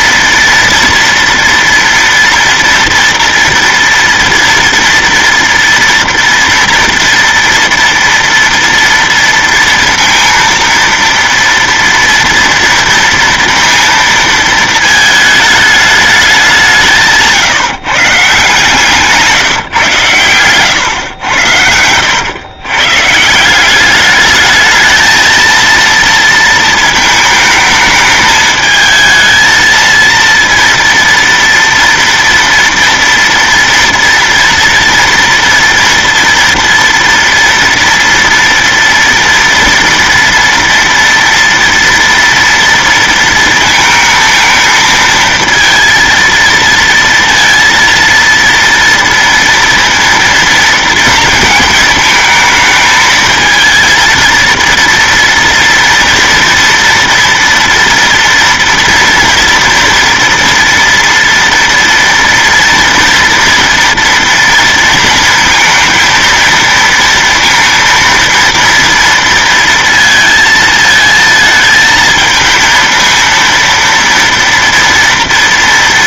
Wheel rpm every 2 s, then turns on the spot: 230, 230, 230, 230, 230, 230, 230, 220, 170, 160, 120, 130, 220, 220, 220, 230, 230, 230, 230, 230, 230, 230, 220, 230, 230, 230, 220, 230, 230, 230, 230, 230, 230, 230, 230, 220, 230, 230.
20-22